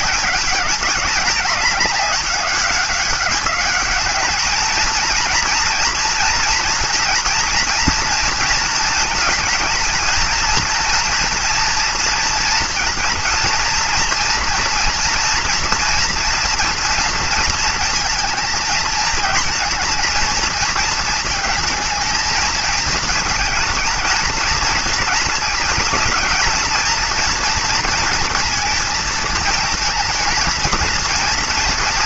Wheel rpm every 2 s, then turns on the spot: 210, 200, 220, 230, 230, 220, 230, 230, 230, 220, 230, 220, 230, 220, 230, 230.
none